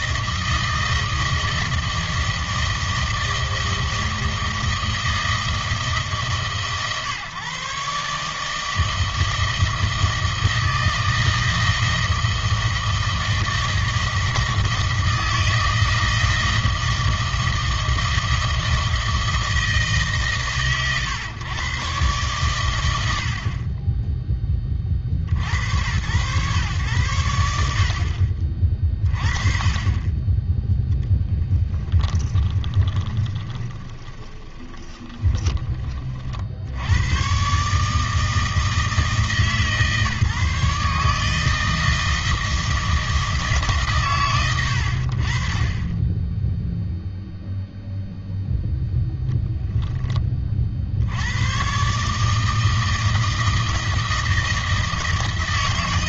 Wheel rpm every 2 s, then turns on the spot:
160, 160, 160, 140, 160, 160, 160, 160, 160, 160, 130, 110, 30, 120, 40, 10, 10, 20, 70, 160, 150, 160, 100, 0, 0, 50, 160, 160.
32-36